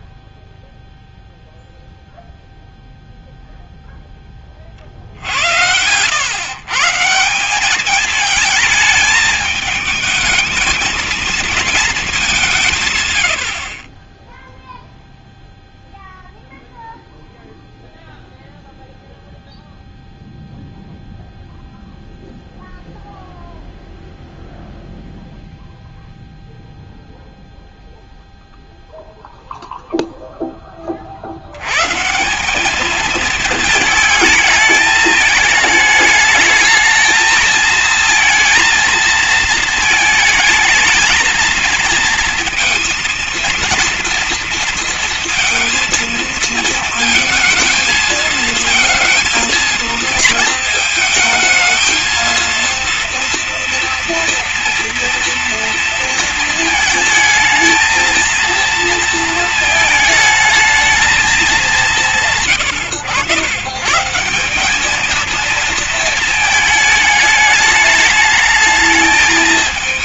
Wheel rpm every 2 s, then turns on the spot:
0, 0, 40, 140, 220, 220, 170, 0, 0, 0, 0, 0, 0, 0, 0, 20, 210, 210, 220, 230, 220, 230, 230, 230, 230, 220, 230, 230, 220, 230, 220, 90, 200, 220, 210.
none